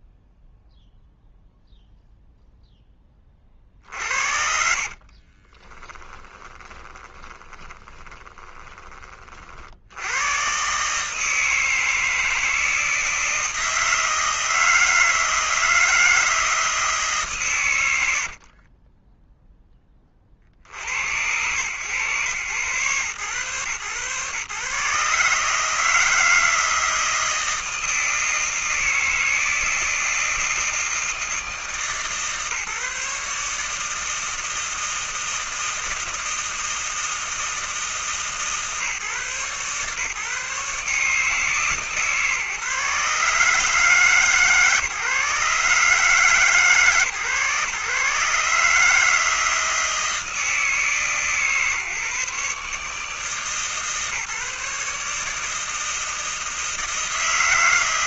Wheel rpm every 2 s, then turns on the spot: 0, 0, 60, 20, 20, 130, 160, 160, 160, 60, 60, 120, 140, 160, 160, 160, 150, 160, 160, 150, 140, 150, 140, 140, 140, 160, 150, 150, 160.
6-10 18-20